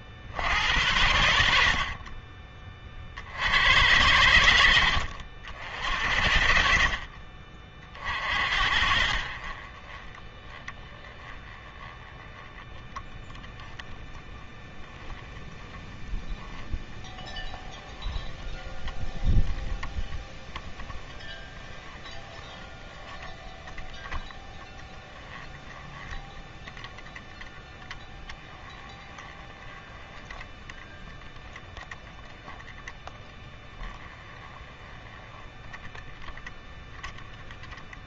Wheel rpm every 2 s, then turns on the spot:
90, 40, 70, 50, 60, 20, 10, 0, 30, 10, 10, 10, 10, 10, 10, 20, 20, 10, 10.
6-8